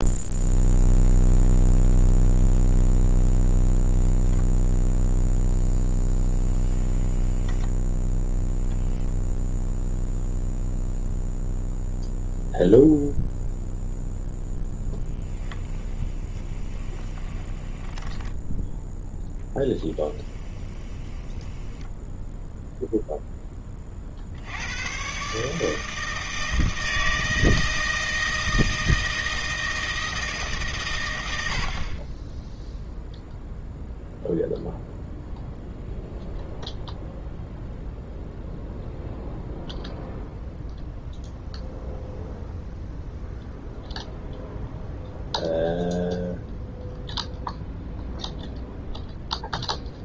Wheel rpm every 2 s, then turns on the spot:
0, 0, 0, 10, 0, 0, 0, 10, 20, 10, 20, 0, 100, 160, 160, 130, 0, 0, 0, 0, 0, 0, 0, 0, 0.
6-8 16-18 20-22